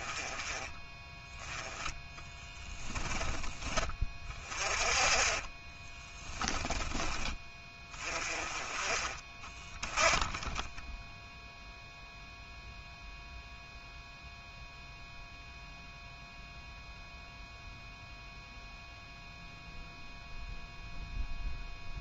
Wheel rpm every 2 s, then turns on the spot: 10, 10, 20, 20, 30, 10, 0, 0, 0, 0, 0.
4-6